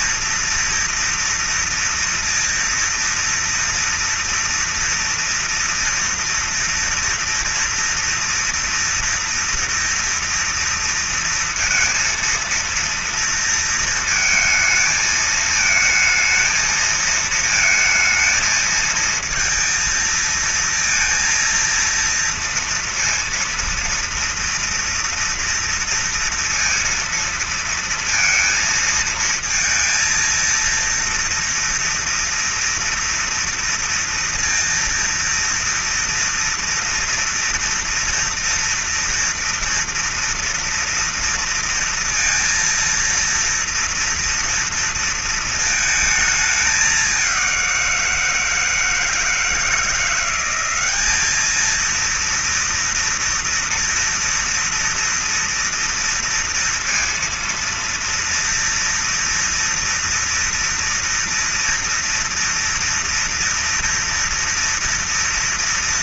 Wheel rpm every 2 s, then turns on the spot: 230, 230, 230, 230, 230, 230, 230, 220, 220, 220, 230, 230, 230, 230, 230, 230, 240, 230, 230, 230, 230, 230, 230, 200, 160, 200, 230, 230, 230, 240, 230, 230, 230.
none